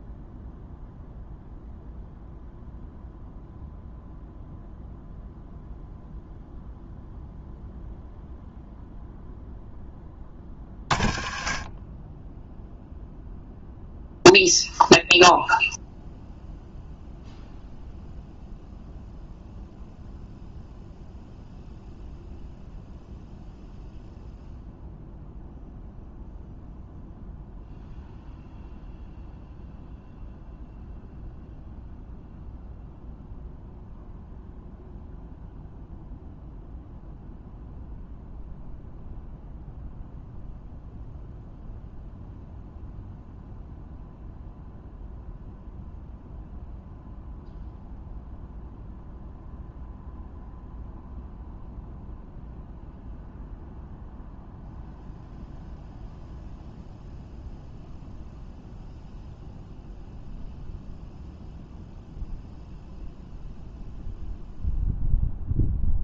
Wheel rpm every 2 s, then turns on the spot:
0, 0, 0, 0, 0, 40, 0, 0, 0, 0, 0, 0, 0, 0, 0, 0, 0, 0, 0, 0, 0, 0, 0, 0, 0, 0, 0, 0, 0, 0, 0, 0, 0.
none